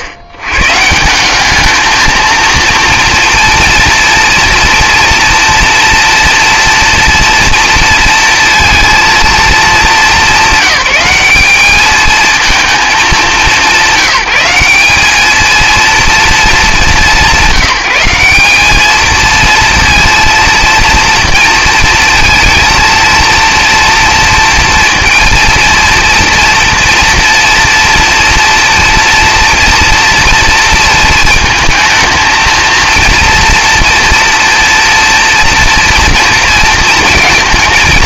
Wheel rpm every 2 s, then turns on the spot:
110, 230, 230, 230, 230, 190, 230, 180, 180, 200, 230, 230, 230, 230, 230, 230, 230, 230, 230.
none